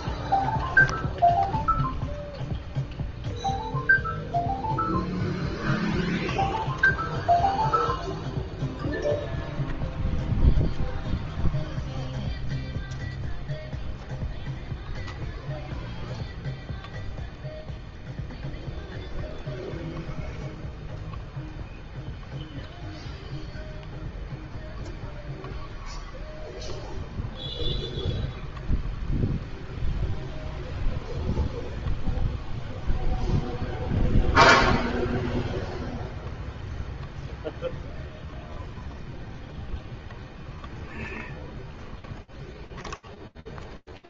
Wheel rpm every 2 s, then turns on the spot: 0, 0, 0, 0, 0, 0, 0, 0, 0, 0, 0, 0, 0, 0, 0, 0, 0, 0, 0, 0, 0, 0.
none